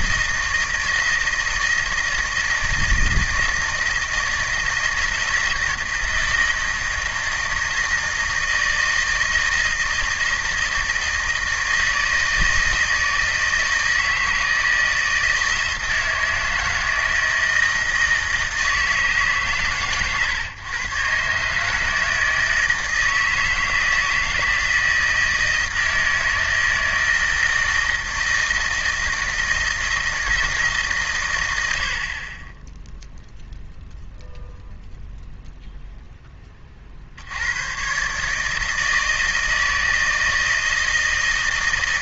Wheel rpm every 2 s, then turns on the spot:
160, 160, 160, 160, 160, 160, 160, 160, 160, 160, 130, 160, 160, 160, 160, 150, 10, 0, 30, 160, 160.
none